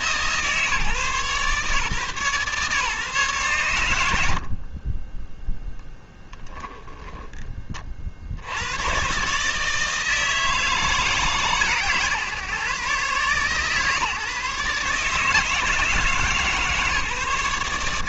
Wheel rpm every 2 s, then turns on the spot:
130, 130, 40, 20, 110, 160, 140, 150, 150.
4-6